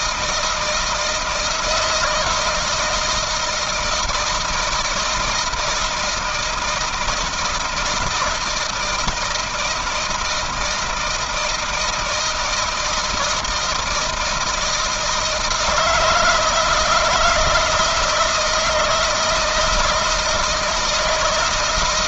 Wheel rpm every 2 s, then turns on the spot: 160, 160, 170, 170, 160, 160, 160, 160, 160, 160, 160.
none